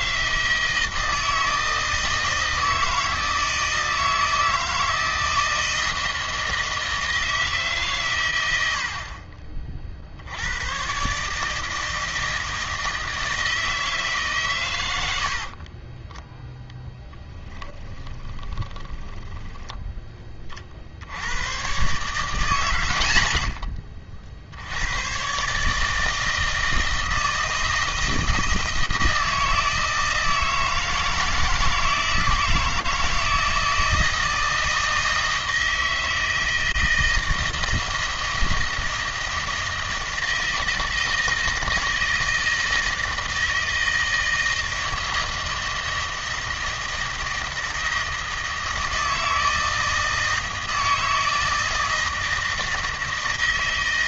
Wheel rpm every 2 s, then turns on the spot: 160, 160, 160, 160, 70, 110, 160, 100, 0, 20, 40, 120, 90, 160, 160, 160, 160, 160, 160, 160, 160, 160, 160, 160, 160, 160, 160.
18-20